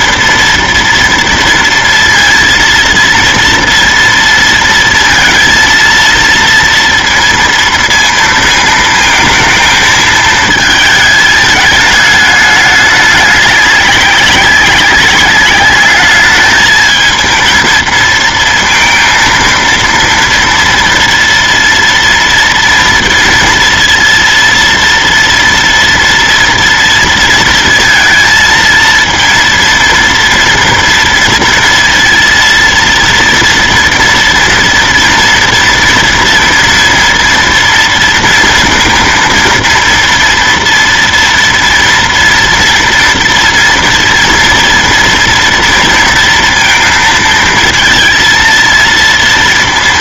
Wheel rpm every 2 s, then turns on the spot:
240, 230, 230, 230, 220, 220, 210, 200, 220, 230, 230, 230, 230, 230, 230, 230, 230, 230, 230, 230, 230, 230, 230, 230, 230.
none